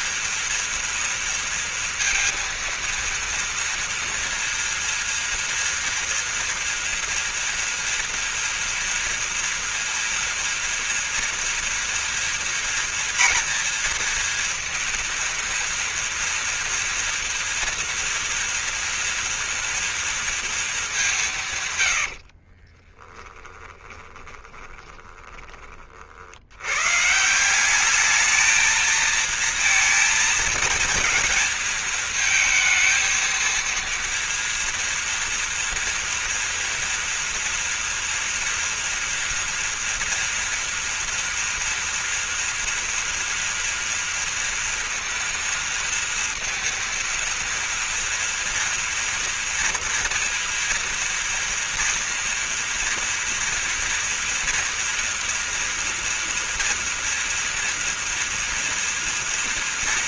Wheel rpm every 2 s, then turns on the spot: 240, 230, 230, 230, 230, 230, 230, 230, 230, 240, 210, 30, 20, 110, 220, 230, 230, 230, 230, 230, 230, 240, 230, 230, 230, 230, 230, 230, 240, 230.
22-26